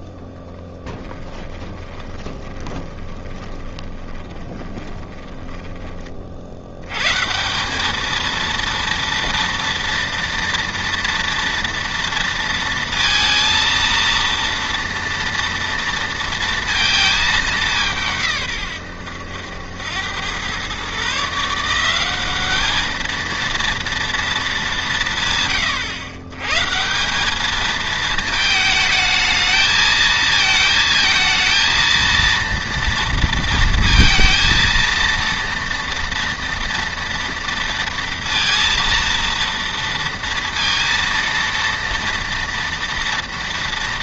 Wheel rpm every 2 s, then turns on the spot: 20, 20, 20, 80, 230, 230, 230, 230, 230, 120, 110, 210, 200, 140, 220, 220, 230, 230, 230, 230, 230, 230.
0-6